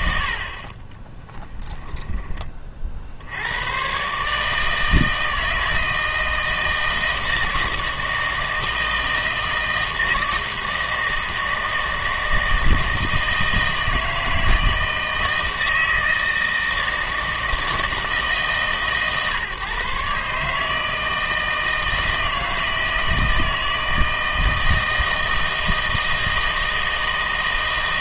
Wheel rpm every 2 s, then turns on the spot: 50, 40, 150, 160, 160, 160, 160, 160, 160, 150, 150, 160, 160, 160.
0-2